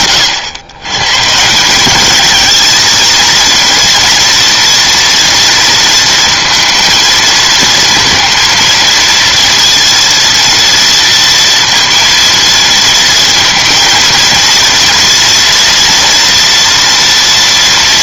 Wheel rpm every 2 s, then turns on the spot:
130, 230, 230, 230, 230, 230, 230, 230, 230.
none